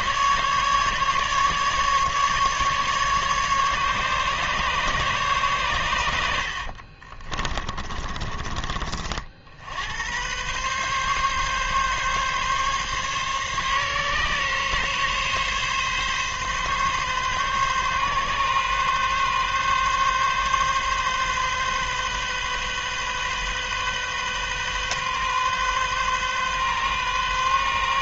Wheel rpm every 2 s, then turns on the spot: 140, 140, 150, 50, 40, 130, 140, 140, 140, 130, 140, 130, 130, 130.
6-8